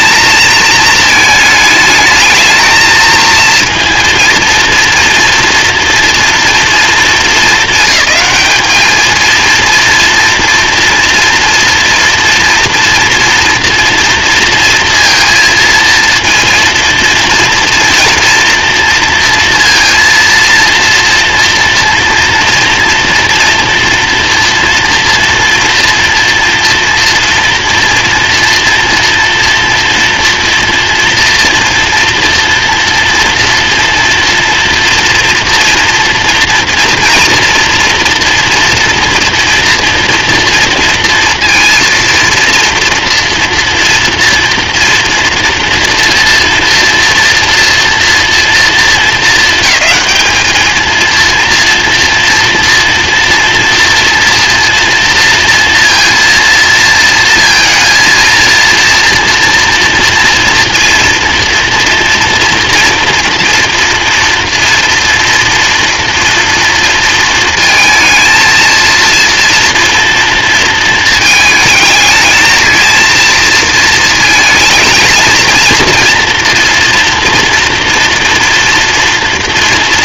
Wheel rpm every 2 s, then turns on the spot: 220, 220, 230, 230, 200, 230, 230, 230, 230, 230, 230, 230, 230, 230, 230, 230, 230, 240, 240, 230, 230, 230, 230, 230, 240, 220, 240, 230, 230, 230, 240, 230, 240, 230, 230, 230, 220, 230, 230, 230.
none